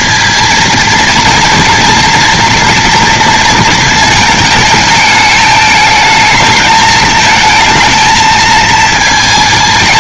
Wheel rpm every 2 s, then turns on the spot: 230, 230, 220, 210, 220.
none